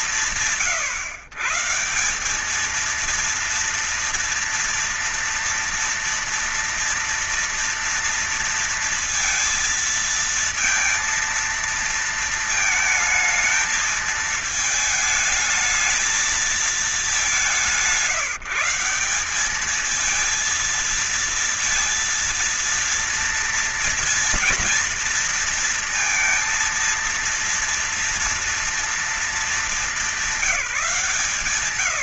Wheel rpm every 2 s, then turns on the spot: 150, 230, 230, 230, 230, 230, 220, 220, 200, 200, 230, 230, 230, 230, 230, 180.
none